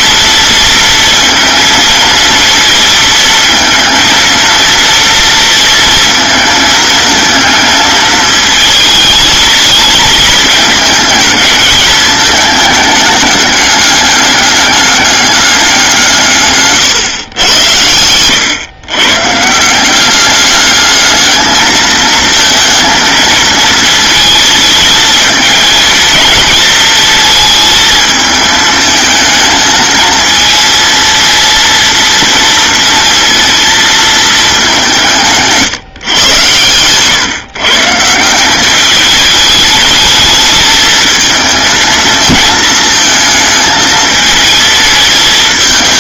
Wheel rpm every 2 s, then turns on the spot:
230, 230, 230, 220, 220, 220, 210, 200, 140, 120, 210, 230, 220, 220, 220, 230, 230, 190, 120, 200, 220, 220, 220.
16-18